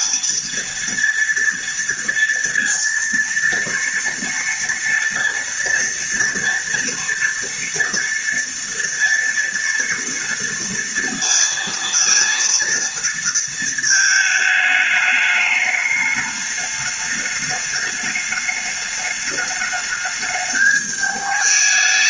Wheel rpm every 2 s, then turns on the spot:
230, 230, 230, 230, 230, 230, 230, 210, 210, 210, 210.
none